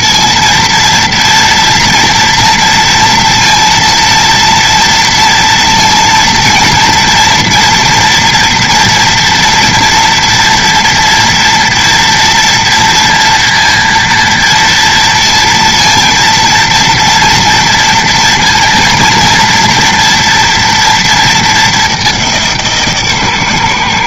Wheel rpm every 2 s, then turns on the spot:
230, 230, 230, 230, 230, 240, 230, 230, 230, 230, 230, 160.
none